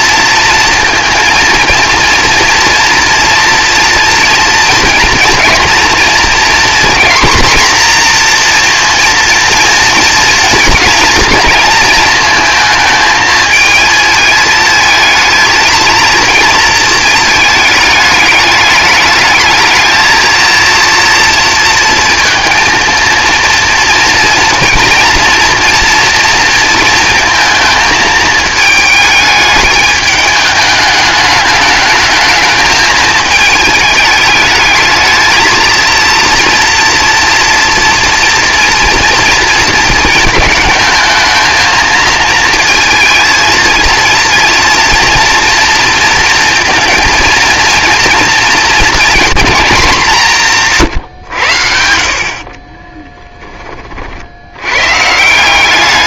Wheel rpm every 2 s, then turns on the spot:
230, 230, 230, 230, 230, 240, 220, 220, 230, 210, 240, 230, 230, 230, 220, 210, 220, 220, 240, 240, 220, 230, 230, 230, 230, 140, 20, 120.
52-54